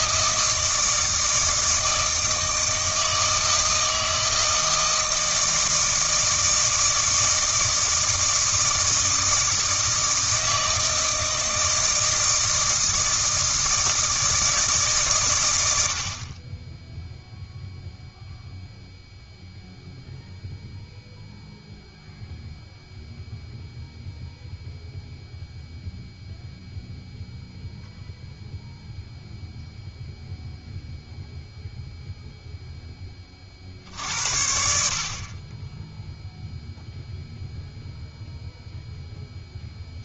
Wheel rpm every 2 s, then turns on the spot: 160, 160, 160, 160, 160, 160, 160, 150, 10, 0, 0, 0, 0, 0, 0, 0, 10, 60, 0, 0.
none